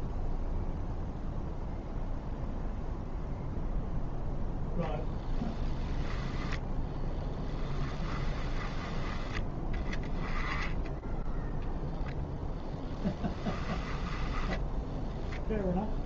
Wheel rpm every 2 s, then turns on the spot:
0, 0, 0, 10, 20, 10, 10, 0.
6-8 10-12